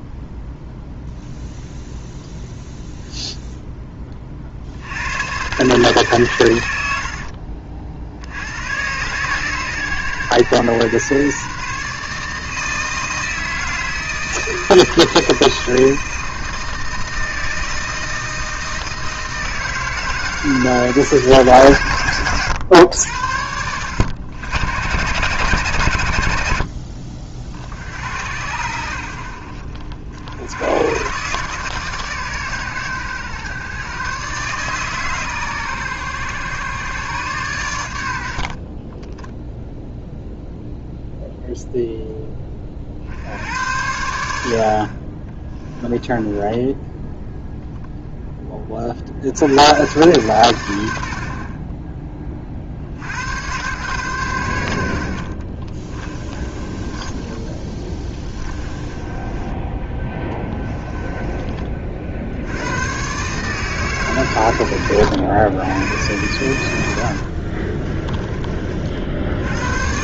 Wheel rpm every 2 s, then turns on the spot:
0, 0, 70, 90, 110, 120, 160, 160, 160, 160, 150, 100, 120, 70, 80, 110, 110, 140, 130, 20, 0, 30, 50, 10, 30, 90, 60, 80, 20, 20, 10, 100, 100, 80, 50.
26-28 46-48 56-62